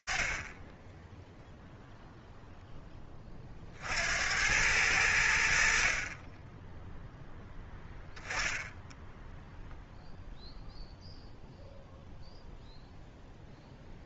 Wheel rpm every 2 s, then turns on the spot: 10, 20, 80, 10, 0, 0, 0.
none